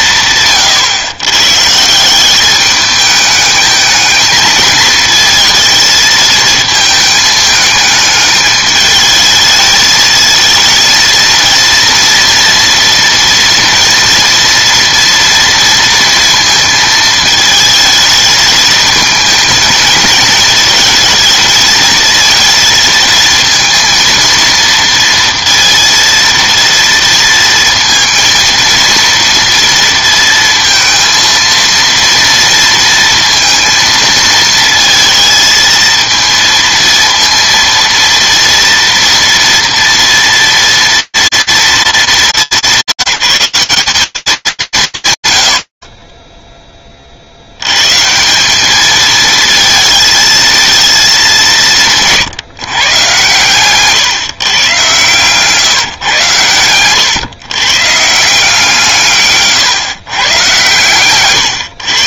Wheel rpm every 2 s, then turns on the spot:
150, 200, 220, 220, 210, 220, 230, 230, 230, 220, 220, 220, 230, 230, 230, 230, 230, 220, 230, 230, 240, 190, 210, 30, 160, 220, 160, 140, 120, 160, 130.
52-54